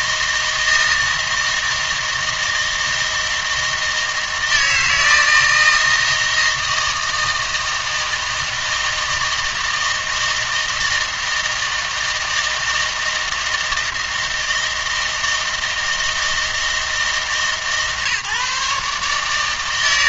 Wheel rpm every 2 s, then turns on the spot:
160, 160, 160, 160, 160, 160, 160, 160, 160, 150.
none